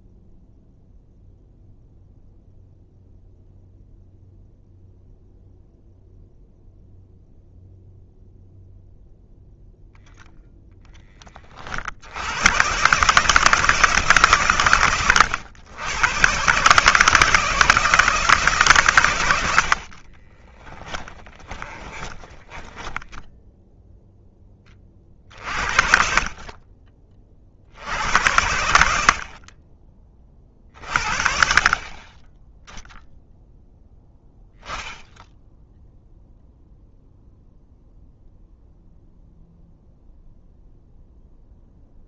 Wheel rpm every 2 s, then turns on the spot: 0, 0, 0, 0, 0, 10, 130, 120, 160, 130, 20, 10, 40, 30, 70, 40, 0, 0, 0, 0, 0.
20-24